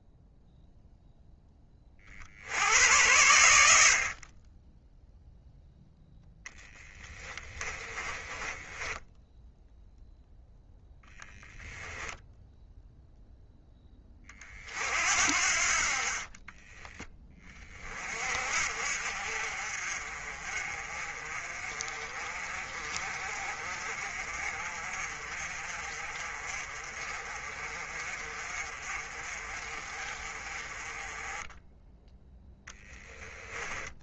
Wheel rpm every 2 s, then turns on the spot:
30, 50, 0, 20, 0, 0, 10, 50, 40, 40, 30, 40, 40, 30, 40, 10, 10.
6-8 32-34